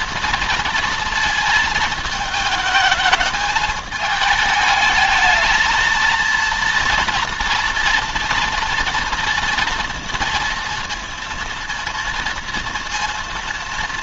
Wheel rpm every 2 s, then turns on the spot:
230, 220, 220, 230, 230, 230, 230.
none